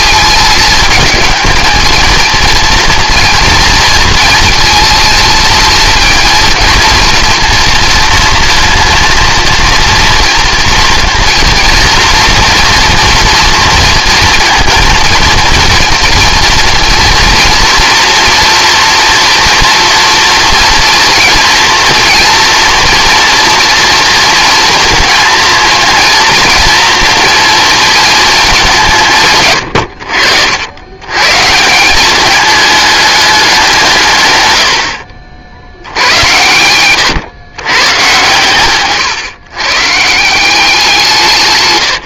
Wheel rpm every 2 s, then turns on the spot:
220, 240, 230, 230, 230, 230, 230, 230, 240, 230, 230, 230, 230, 230, 170, 100, 210, 70, 120, 130, 170.
38-40